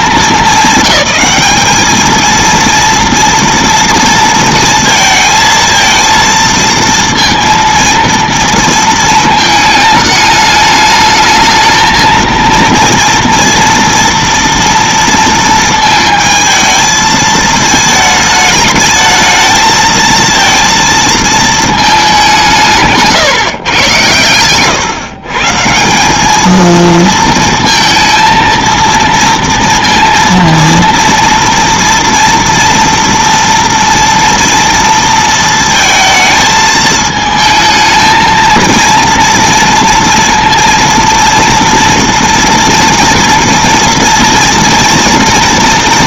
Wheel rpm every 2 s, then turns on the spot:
200, 230, 230, 230, 230, 210, 230, 230, 220, 220, 230, 170, 120, 220, 230, 230, 230, 230, 220, 230, 230, 230, 240.
none